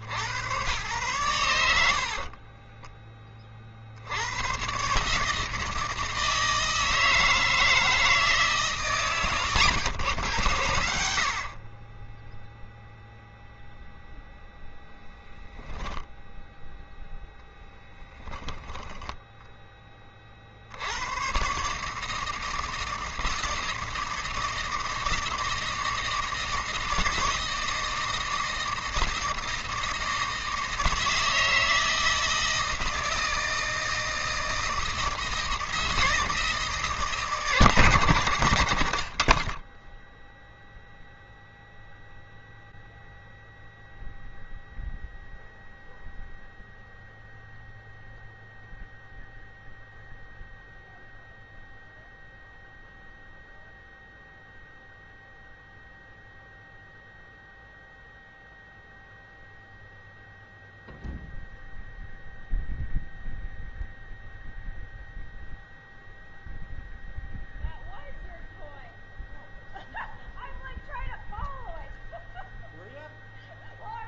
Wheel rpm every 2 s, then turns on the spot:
80, 40, 110, 160, 150, 100, 10, 0, 0, 10, 40, 160, 160, 160, 160, 160, 160, 160, 160, 110, 0, 0, 0, 0, 0, 0, 0, 0, 0, 0, 0, 0, 0, 0, 0, 0, 0.
2-4